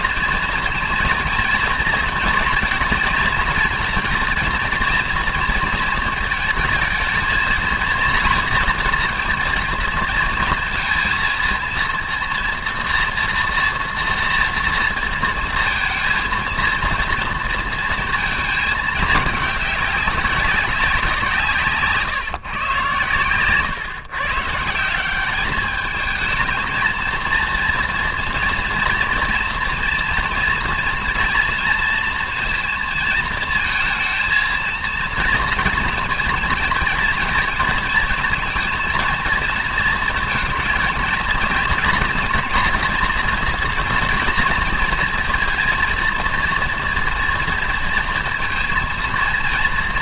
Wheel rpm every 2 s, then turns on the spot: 230, 230, 230, 220, 230, 230, 230, 230, 230, 220, 200, 130, 140, 220, 230, 230, 230, 230, 230, 230, 230, 230, 230, 230, 230.
none